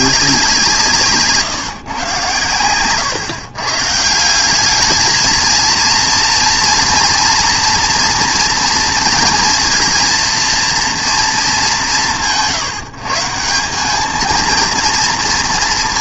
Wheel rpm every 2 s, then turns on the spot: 160, 110, 200, 230, 230, 230, 140, 230.
none